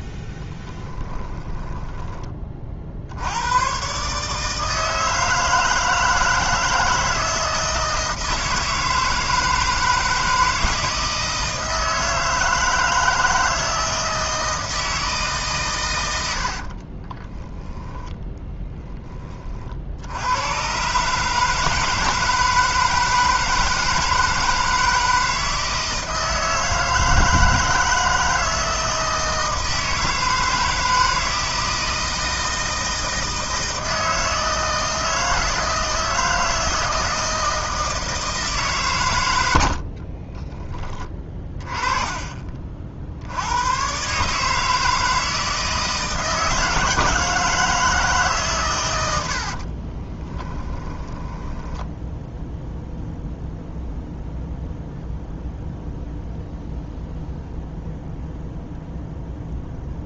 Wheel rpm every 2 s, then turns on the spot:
20, 40, 160, 160, 160, 160, 160, 160, 70, 10, 120, 160, 160, 160, 160, 160, 160, 160, 160, 140, 20, 40, 150, 160, 130, 20, 0, 0, 0, 0.
0-2 16-18 50-52